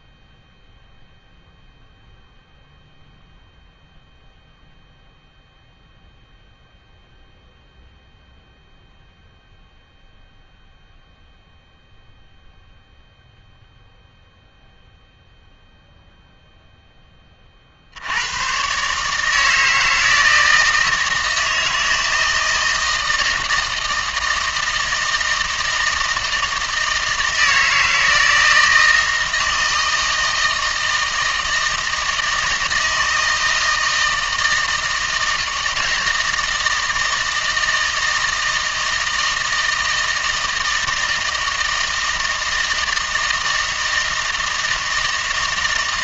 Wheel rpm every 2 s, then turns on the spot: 0, 0, 0, 0, 0, 0, 0, 0, 0, 140, 160, 160, 160, 160, 160, 160, 160, 160, 160, 160, 160, 160, 160.
none